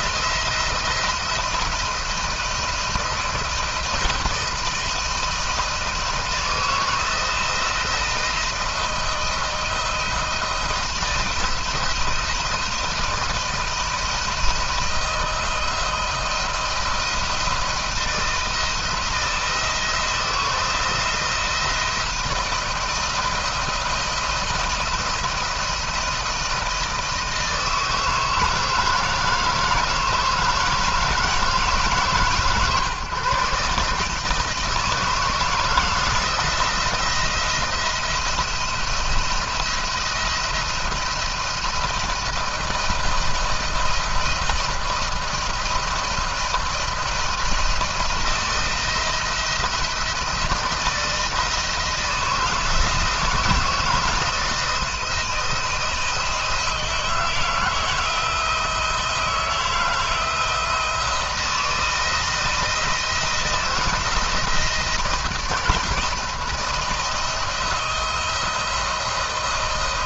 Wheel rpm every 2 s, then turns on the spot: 170, 160, 160, 170, 170, 170, 170, 170, 170, 170, 160, 160, 170, 160, 160, 160, 130, 160, 170, 170, 170, 170, 170, 160, 170, 160, 160, 170, 170, 170, 160, 160, 170, 170, 170.
none